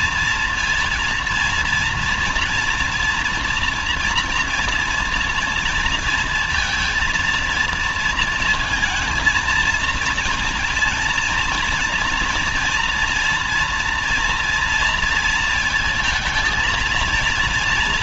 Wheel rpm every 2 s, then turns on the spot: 230, 240, 240, 230, 230, 230, 230, 230, 220.
none